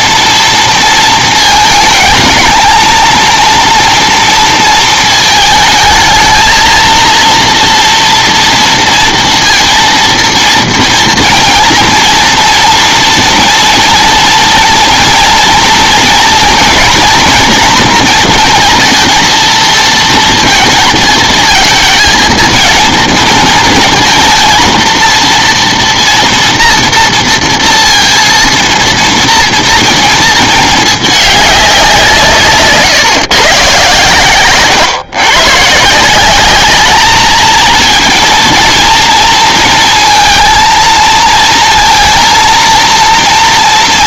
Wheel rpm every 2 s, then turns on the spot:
230, 220, 230, 220, 230, 230, 230, 230, 240, 230, 230, 230, 230, 230, 230, 220, 150, 130, 200, 230, 230, 230.
none